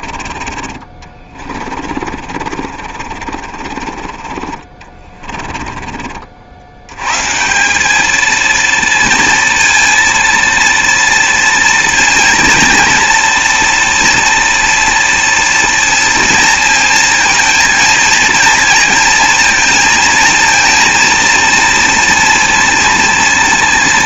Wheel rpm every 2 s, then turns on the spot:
40, 50, 40, 90, 230, 230, 230, 230, 230, 230, 230, 230.
2-6